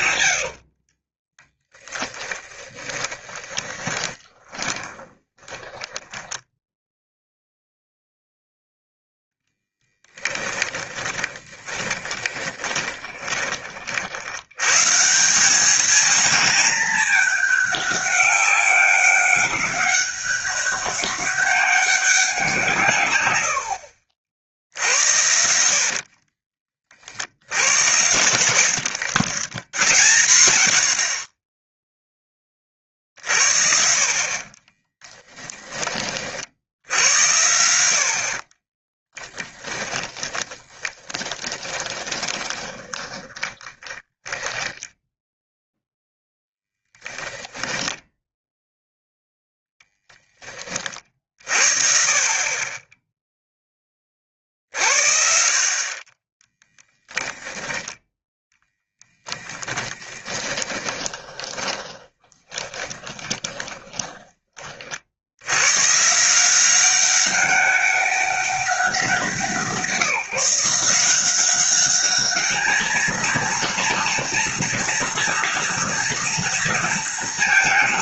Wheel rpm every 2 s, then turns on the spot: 50, 30, 20, 0, 0, 10, 20, 160, 210, 200, 200, 150, 70, 50, 100, 60, 50, 10, 80, 40, 20, 20, 10, 10, 0, 30, 10, 60, 0, 0, 20, 20, 50, 190, 180, 170, 220, 240, 230.
0-6 10-14 34-36 38-46 60-64